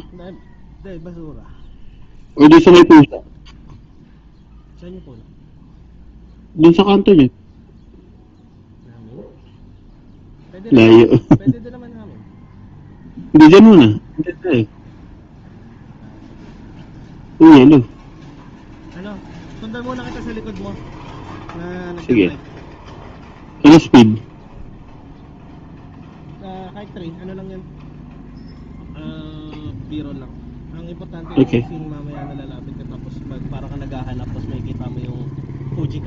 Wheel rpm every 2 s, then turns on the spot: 0, 0, 0, 0, 0, 0, 0, 0, 0, 0, 0, 0, 0, 0, 0, 0, 0, 0.
none